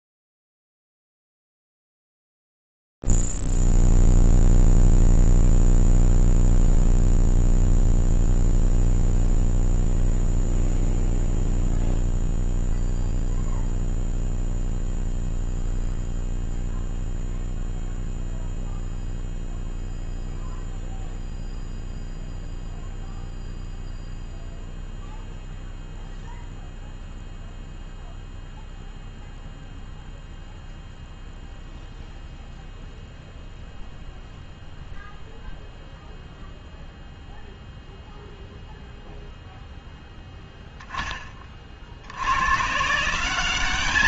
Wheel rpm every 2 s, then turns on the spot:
0, 0, 0, 0, 0, 0, 0, 0, 0, 0, 0, 0, 0, 0, 0, 0, 0, 0, 0, 0, 10, 100.
none